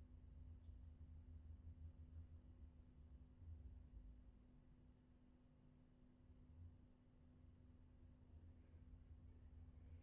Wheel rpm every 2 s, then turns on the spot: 0, 0, 0, 0, 0.
none